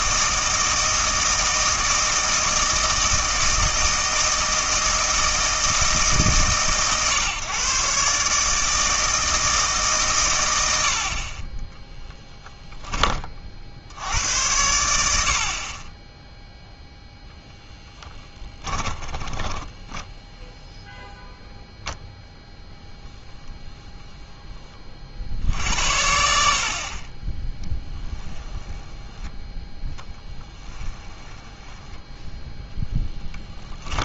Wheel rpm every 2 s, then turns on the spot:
160, 160, 160, 140, 160, 80, 10, 90, 0, 10, 0, 10, 20, 50, 10, 20, 10.
18-20 22-24 28-32